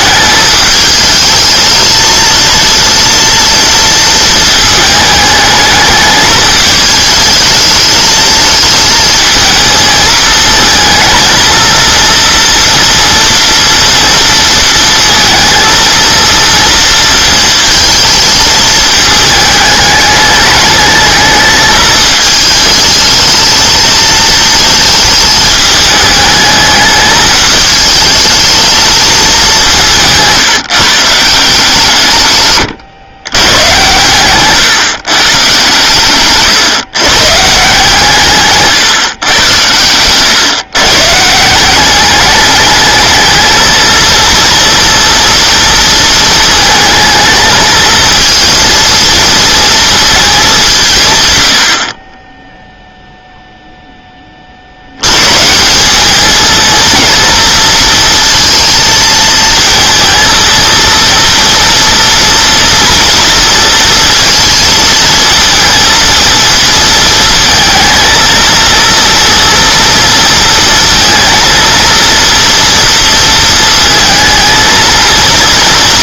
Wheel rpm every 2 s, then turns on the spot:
210, 220, 220, 220, 220, 230, 230, 230, 230, 220, 210, 220, 220, 210, 220, 160, 130, 140, 130, 150, 130, 210, 230, 220, 230, 180, 0, 70, 230, 230, 230, 230, 230, 230, 230, 230, 230, 230.
32-34